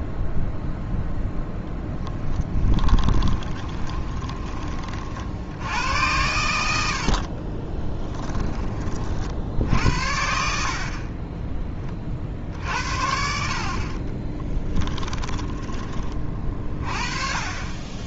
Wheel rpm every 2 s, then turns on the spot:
0, 10, 40, 70, 40, 40, 60, 10, 30.
2-4 14-16